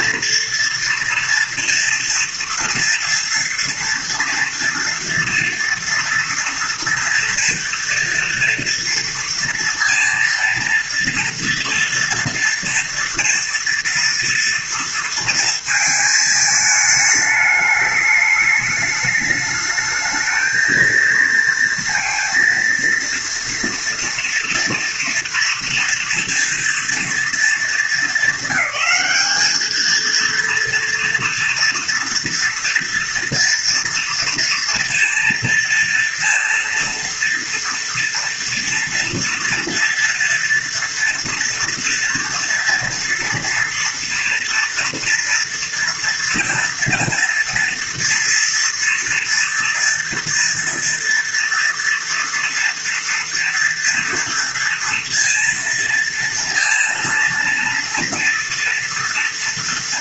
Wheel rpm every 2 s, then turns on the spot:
230, 230, 230, 230, 240, 230, 240, 230, 210, 210, 220, 230, 230, 230, 200, 230, 230, 230, 230, 230, 230, 230, 230, 230, 230, 240, 230, 230, 230, 230.
none